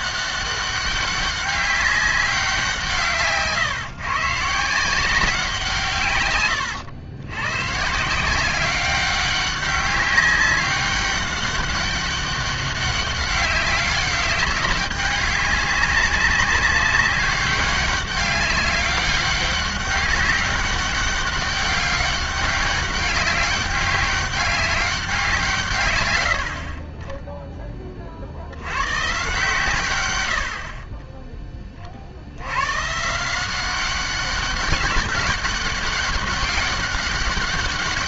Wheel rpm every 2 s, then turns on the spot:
190, 180, 160, 110, 190, 200, 200, 200, 190, 200, 200, 200, 200, 60, 100, 50, 110, 200, 200.
none